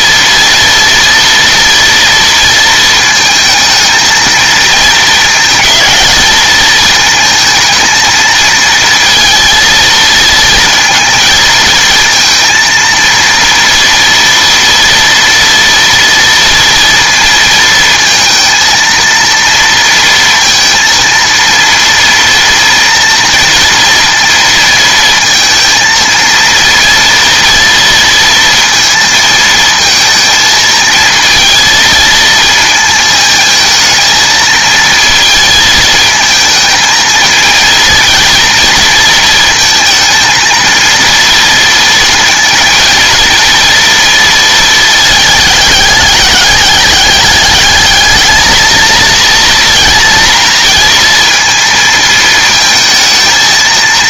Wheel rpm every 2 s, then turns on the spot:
230, 230, 220, 220, 230, 230, 230, 230, 230, 230, 230, 230, 230, 230, 230, 220, 220, 230, 220, 230, 230, 230, 220, 200, 220, 230, 220.
none